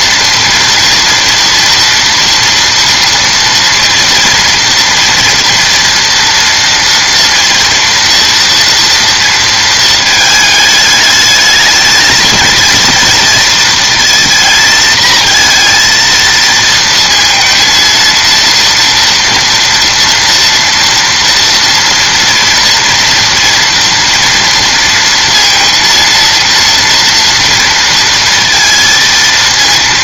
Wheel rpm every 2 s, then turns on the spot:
240, 230, 230, 240, 230, 210, 230, 230, 230, 230, 230, 230, 230, 230, 230.
none